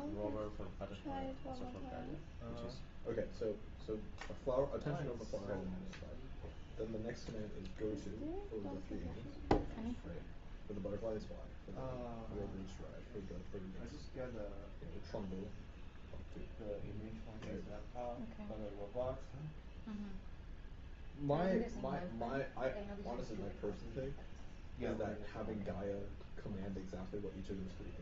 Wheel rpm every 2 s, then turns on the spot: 0, 0, 0, 0, 0, 0, 0, 0, 0, 0, 0, 0, 0, 0.
none